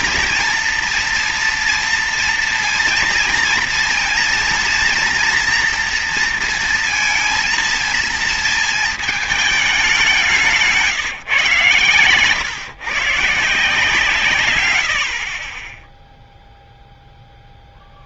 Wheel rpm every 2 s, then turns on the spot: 230, 230, 230, 230, 230, 190, 130, 120, 0.
10-12